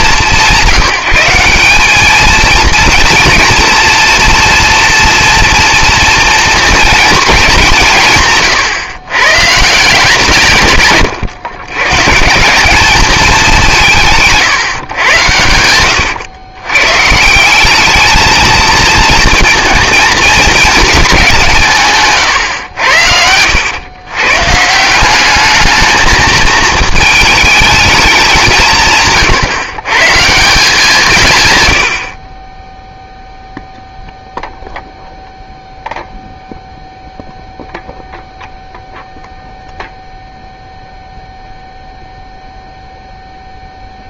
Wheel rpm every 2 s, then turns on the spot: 170, 230, 240, 240, 140, 140, 170, 150, 110, 220, 230, 110, 150, 220, 170, 170, 20, 0, 0, 0, 0, 0.
none